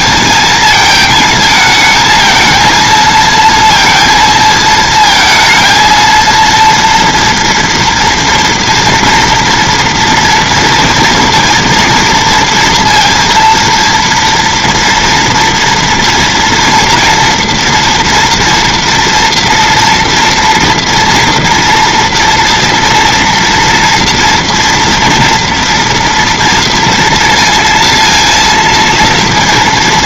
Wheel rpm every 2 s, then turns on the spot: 220, 230, 220, 230, 230, 230, 230, 230, 230, 230, 230, 230, 230, 230, 230.
none